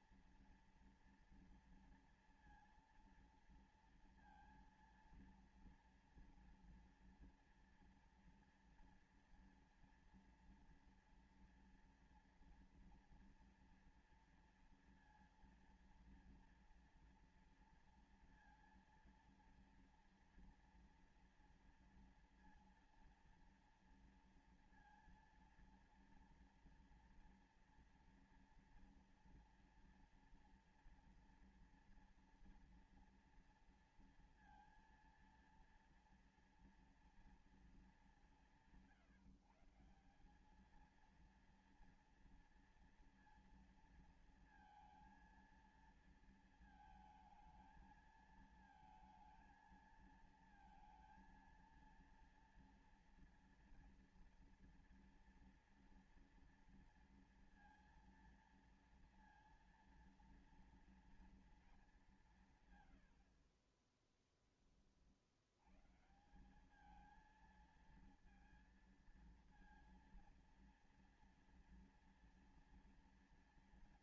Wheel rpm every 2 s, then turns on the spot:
230, 230, 230, 230, 240, 230, 230, 230, 230, 230, 240, 230, 230, 230, 230, 230, 230, 230, 240, 180, 200, 230, 230, 230, 220, 230, 230, 230, 230, 230, 230, 170, 20, 170, 230, 230, 230.
none